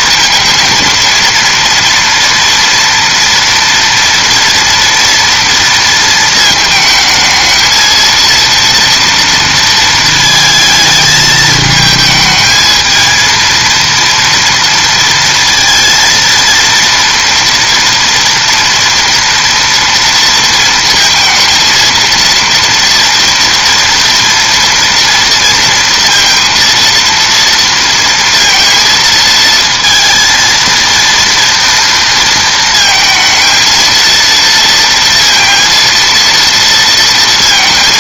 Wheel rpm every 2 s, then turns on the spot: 230, 230, 230, 220, 230, 220, 220, 230, 230, 230, 230, 230, 230, 230, 230, 230, 230, 230, 230.
none